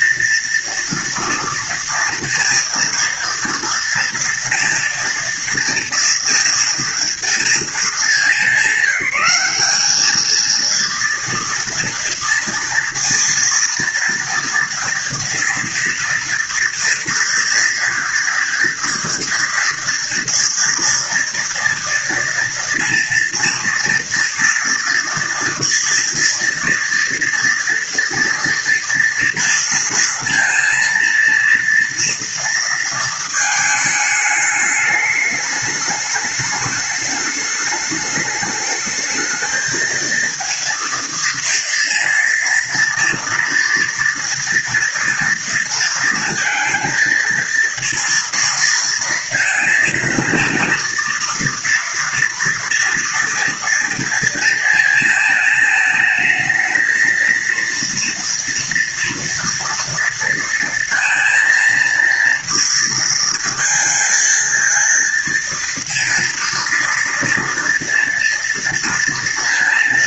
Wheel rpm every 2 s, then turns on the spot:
230, 230, 230, 230, 200, 230, 230, 230, 230, 240, 230, 230, 230, 230, 230, 230, 230, 210, 210, 210, 230, 230, 230, 230, 230, 230, 230, 230, 220, 230, 230, 230, 230, 230, 230.
none